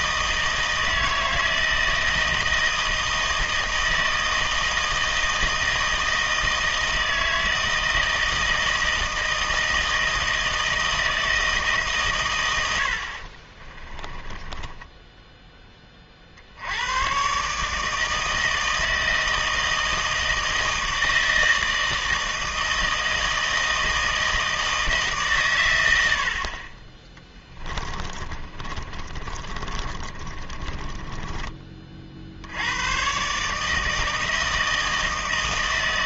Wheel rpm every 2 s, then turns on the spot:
160, 160, 160, 160, 160, 160, 100, 20, 80, 160, 160, 160, 160, 40, 30, 30, 80, 160.
14-16 28-32